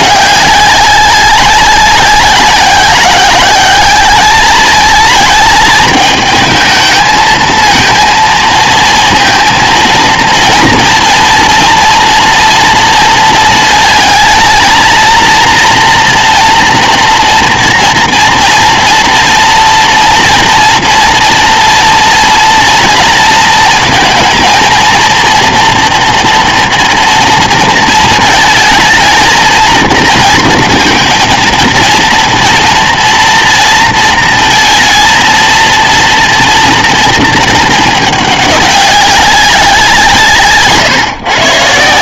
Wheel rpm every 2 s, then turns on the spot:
200, 190, 210, 220, 230, 230, 230, 230, 230, 230, 230, 230, 230, 230, 220, 230, 230, 230, 230, 200, 150.
none